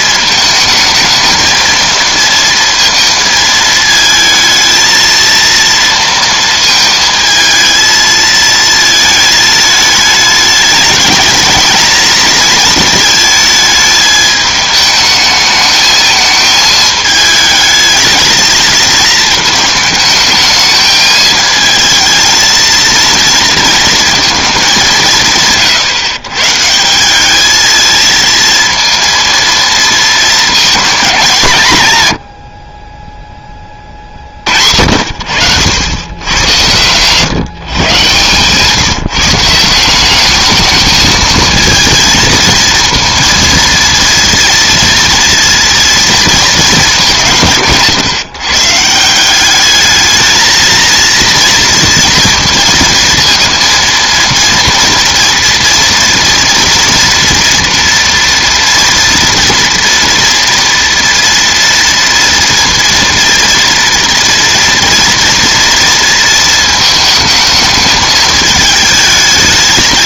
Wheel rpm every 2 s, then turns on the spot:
220, 230, 220, 230, 220, 210, 230, 210, 220, 230, 220, 230, 200, 170, 230, 230, 30, 70, 120, 150, 210, 230, 230, 220, 160, 220, 230, 230, 230, 230, 230, 230, 240, 220, 220.
none